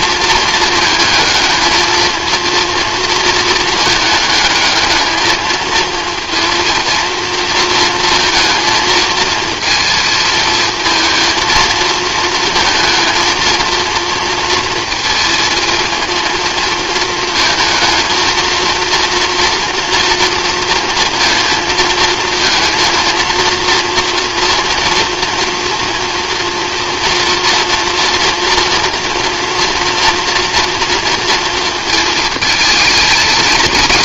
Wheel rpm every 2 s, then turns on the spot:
220, 230, 220, 230, 230, 220, 220, 230, 220, 230, 230, 230, 230, 230, 240, 240, 220.
none